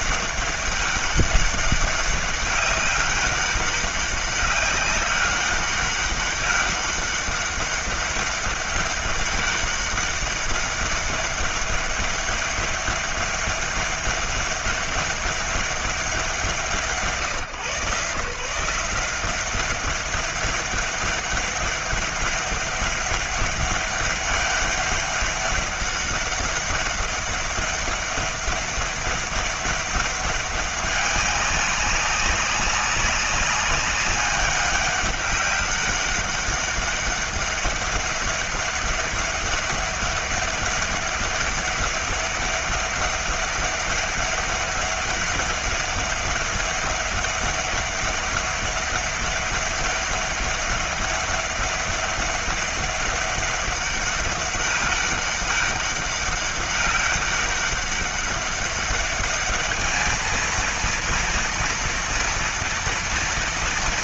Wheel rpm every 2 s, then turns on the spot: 200, 200, 200, 200, 200, 200, 200, 200, 160, 170, 200, 200, 200, 200, 200, 200, 200, 200, 200, 200, 200, 200, 200, 200, 200, 200, 200, 200, 200, 200, 230, 230.
none